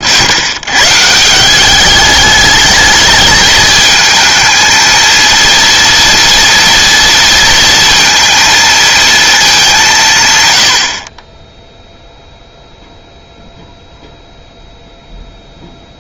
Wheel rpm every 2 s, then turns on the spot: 120, 210, 220, 230, 230, 100, 0, 0.
none